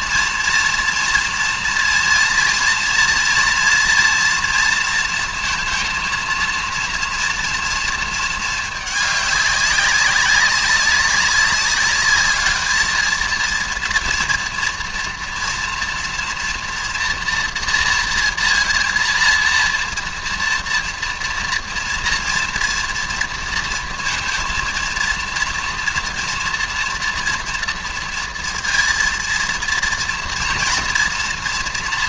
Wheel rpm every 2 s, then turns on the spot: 230, 230, 230, 230, 220, 200, 220, 240, 240, 230, 230, 230, 230, 240, 230, 240.
none